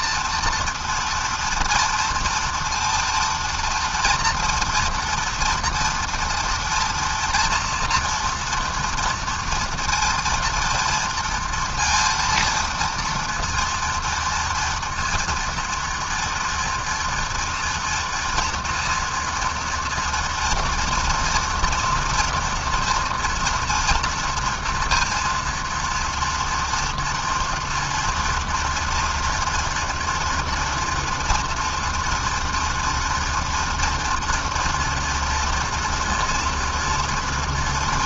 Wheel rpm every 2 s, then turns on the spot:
230, 230, 230, 230, 230, 230, 230, 230, 230, 230, 230, 230, 230, 230, 240, 230, 230, 230, 230.
none